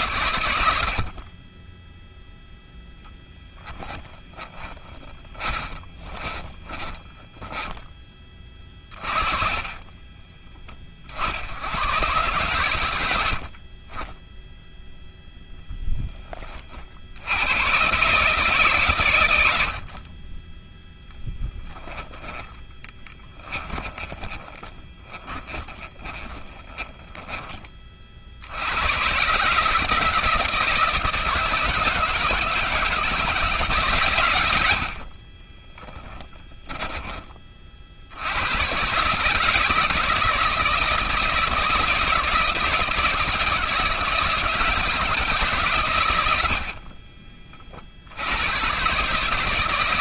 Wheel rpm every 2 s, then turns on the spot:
50, 10, 20, 10, 30, 70, 80, 0, 70, 120, 0, 10, 20, 20, 120, 160, 160, 50, 20, 130, 160, 170, 160, 50, 130.
2-10 22-28 34-36 46-48